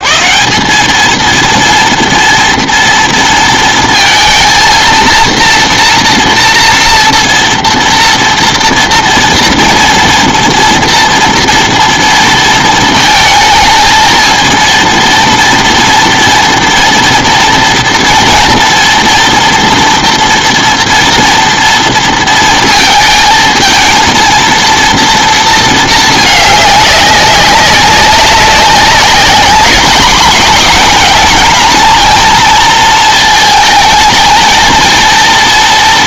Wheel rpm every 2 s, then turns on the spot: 170, 230, 230, 230, 230, 230, 220, 230, 230, 230, 240, 230, 230, 200, 200, 220, 230, 220.
none